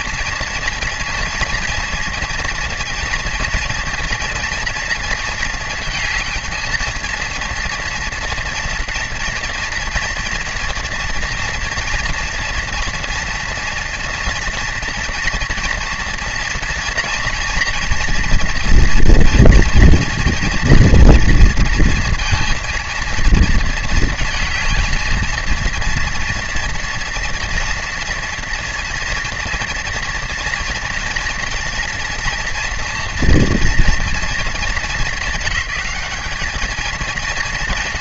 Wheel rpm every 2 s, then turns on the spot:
230, 230, 230, 220, 230, 240, 230, 230, 230, 230, 230, 230, 220, 230, 230, 230, 240, 220, 220.
none